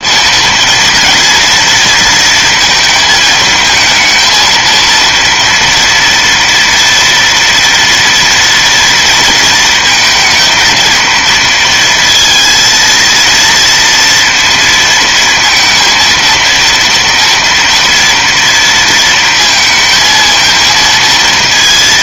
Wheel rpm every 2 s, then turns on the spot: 230, 220, 230, 230, 230, 220, 230, 230, 230, 230, 220.
none